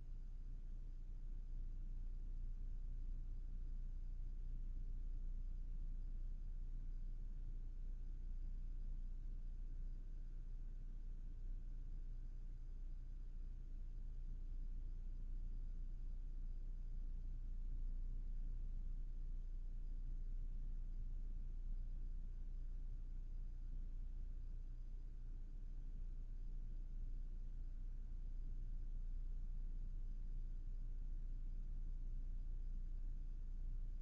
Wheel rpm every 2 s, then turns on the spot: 0, 0, 0, 0, 0, 0, 0, 0, 0, 0, 0, 0, 0, 0, 0, 0, 0.
none